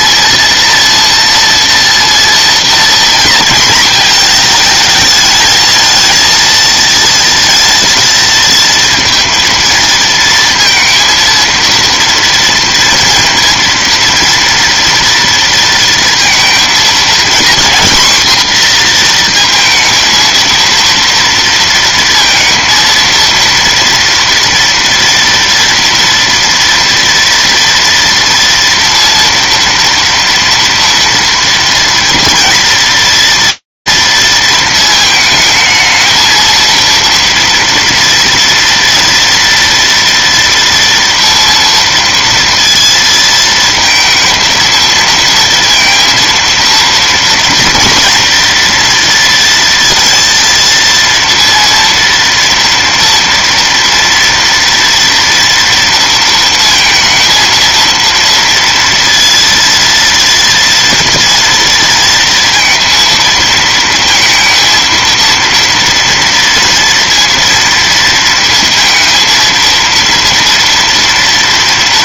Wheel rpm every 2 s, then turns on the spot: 230, 230, 220, 230, 230, 230, 230, 230, 230, 240, 230, 230, 230, 230, 230, 230, 230, 220, 230, 230, 230, 220, 230, 230, 230, 230, 230, 230, 230, 230, 230, 230, 230, 230, 230, 230.
none